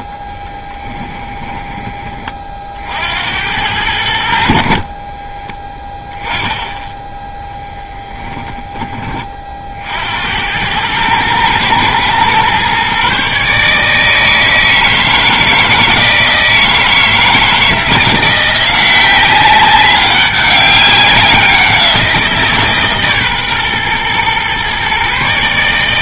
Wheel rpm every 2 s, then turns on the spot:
20, 40, 60, 10, 10, 90, 130, 160, 160, 180, 190, 160, 130.
0-2